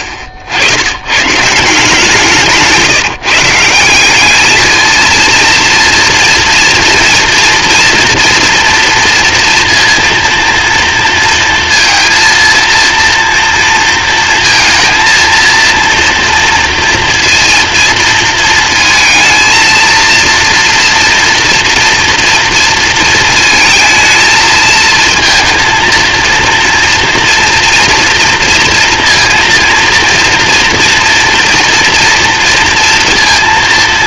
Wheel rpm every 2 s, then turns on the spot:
70, 150, 220, 230, 230, 230, 230, 230, 230, 220, 230, 230, 220, 230, 230, 230, 230.
none